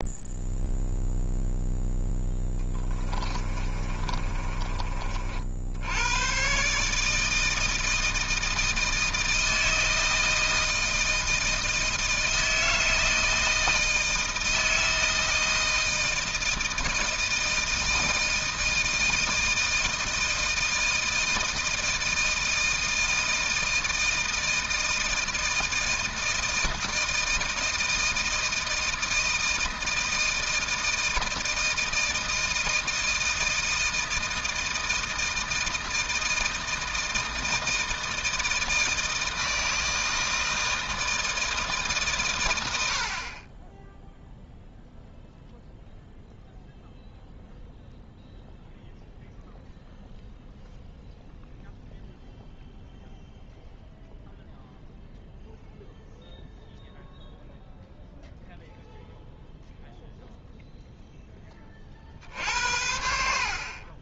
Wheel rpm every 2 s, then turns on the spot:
0, 20, 30, 140, 160, 160, 160, 160, 160, 160, 160, 160, 160, 160, 160, 160, 160, 160, 160, 160, 160, 80, 0, 0, 0, 0, 0, 0, 0, 0, 0, 70.
2-4